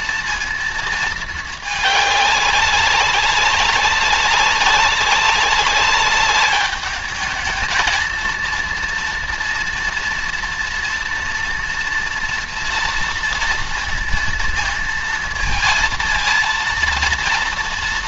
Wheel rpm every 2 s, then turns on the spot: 220, 200, 190, 210, 230, 230, 230, 230, 230.
none